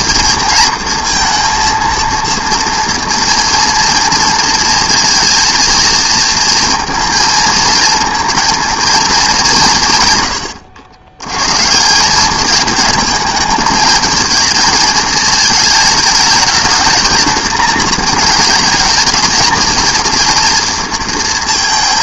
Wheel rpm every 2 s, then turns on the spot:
230, 230, 230, 230, 220, 110, 210, 220, 220, 220, 230.
none